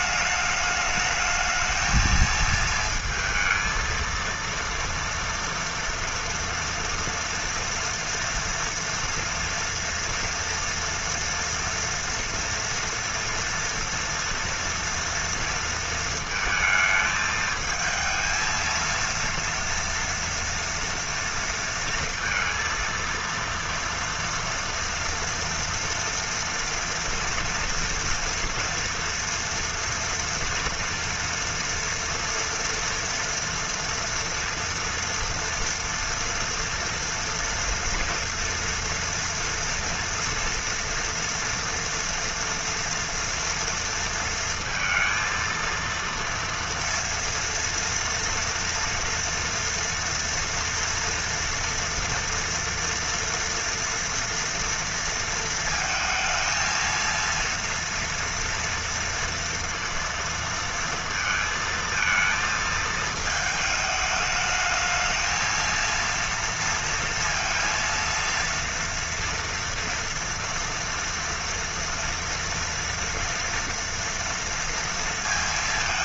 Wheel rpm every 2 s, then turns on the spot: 210, 220, 230, 230, 240, 230, 230, 230, 230, 220, 230, 230, 230, 240, 230, 230, 240, 230, 230, 240, 230, 230, 230, 230, 230, 230, 230, 230, 220, 230, 230, 220, 210, 230, 230, 230, 230, 230.
none